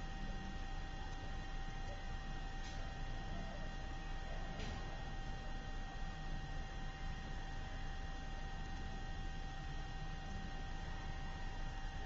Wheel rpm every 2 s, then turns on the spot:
0, 0, 0, 0, 0, 0.
none